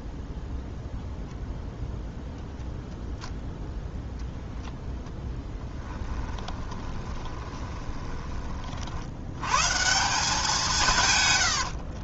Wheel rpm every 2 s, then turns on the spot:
0, 0, 0, 20, 30, 180.
6-8